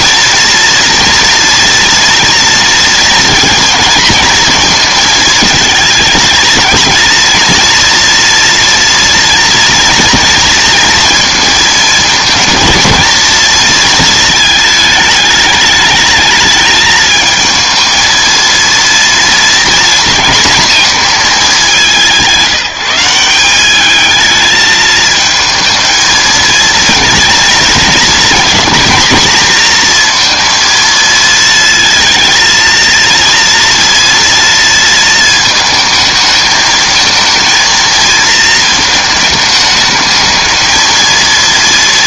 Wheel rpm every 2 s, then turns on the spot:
240, 230, 220, 230, 230, 230, 220, 220, 210, 230, 240, 180, 220, 230, 230, 230, 230, 230, 220, 220, 220.
none